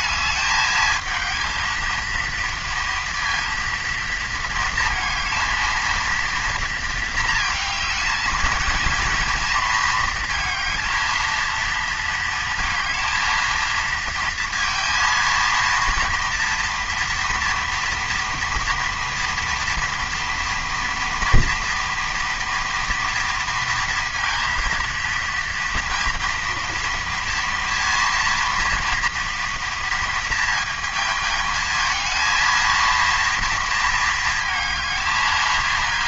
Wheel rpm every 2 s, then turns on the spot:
220, 230, 230, 220, 230, 230, 230, 230, 230, 240, 230, 230, 230, 230, 230, 220, 230, 220.
none